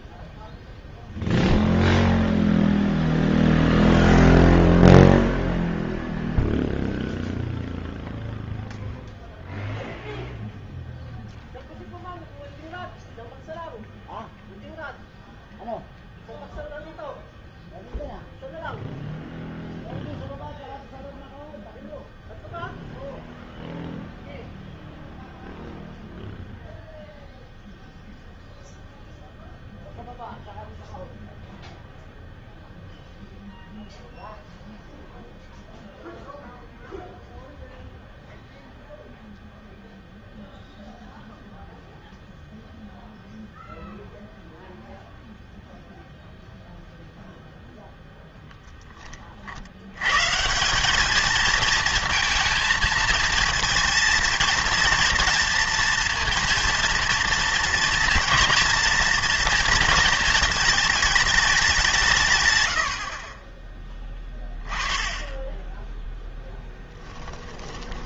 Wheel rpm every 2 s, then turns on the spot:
0, 0, 0, 0, 0, 0, 0, 0, 0, 0, 0, 0, 0, 0, 0, 0, 0, 0, 0, 0, 0, 0, 0, 0, 10, 180, 230, 230, 230, 240, 220, 120, 20, 10.
66-68